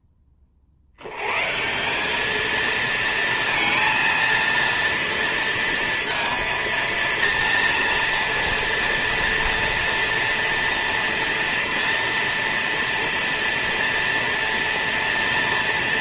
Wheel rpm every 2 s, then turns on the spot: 100, 230, 230, 230, 230, 230, 230, 230.
none